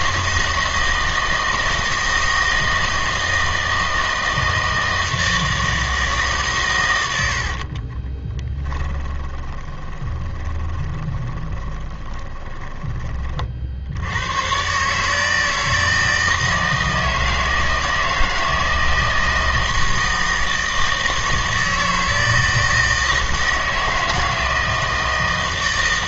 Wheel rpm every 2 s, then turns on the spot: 160, 160, 160, 130, 10, 20, 20, 130, 160, 160, 160, 160, 160.
8-14